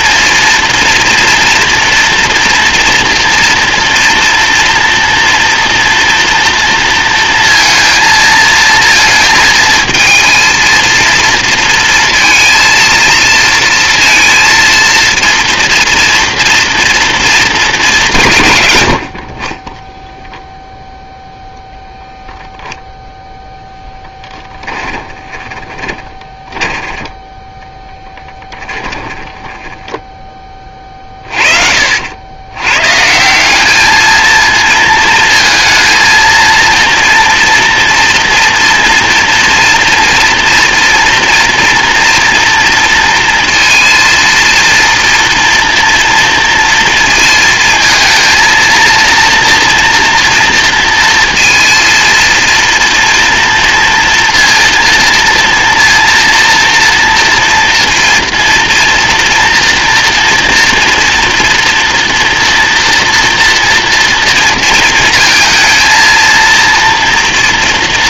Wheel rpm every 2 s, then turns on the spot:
230, 230, 240, 230, 220, 230, 230, 230, 230, 70, 0, 0, 10, 10, 10, 30, 130, 230, 230, 240, 230, 230, 230, 230, 230, 230, 230, 230, 230, 230, 230, 230, 230, 230.
24-30